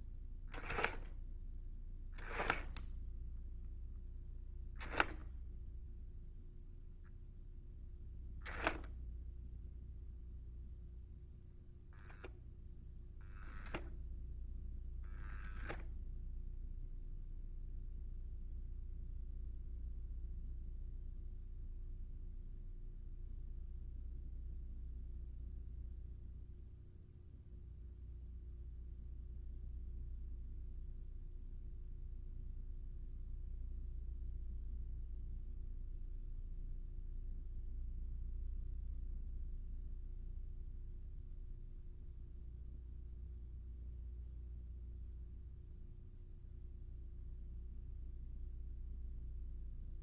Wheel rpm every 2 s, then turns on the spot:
10, 0, 0, 0, 0, 0, 0, 0, 0, 0, 0, 0, 0, 0, 0, 0, 0, 0, 0, 0, 0, 0, 0, 0, 0.
none